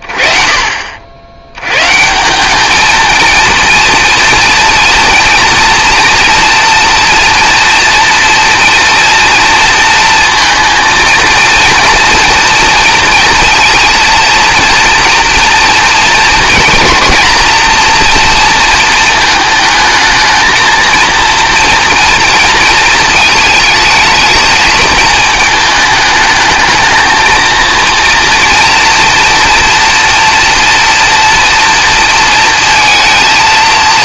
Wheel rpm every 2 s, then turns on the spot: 50, 200, 230, 230, 230, 230, 230, 230, 240, 230, 230, 230, 220, 220, 230, 230, 230.
none